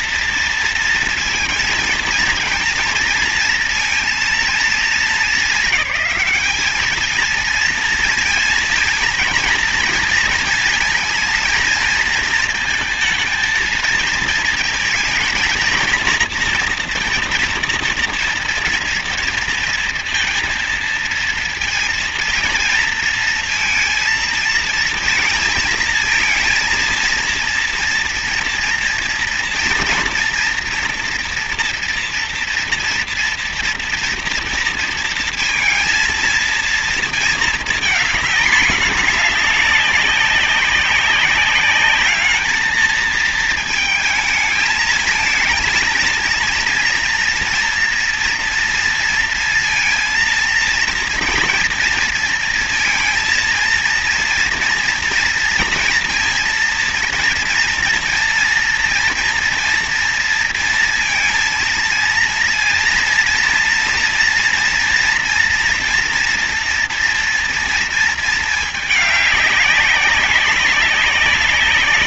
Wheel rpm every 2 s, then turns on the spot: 230, 230, 230, 210, 230, 230, 230, 220, 230, 230, 230, 230, 230, 230, 230, 230, 230, 230, 220, 210, 200, 220, 220, 230, 230, 230, 230, 230, 230, 230, 230, 230, 230, 240, 210, 190.
none